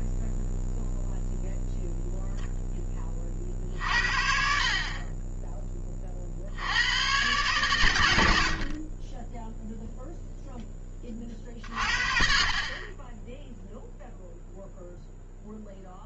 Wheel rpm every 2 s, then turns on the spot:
0, 10, 40, 100, 30, 20, 20, 0.
none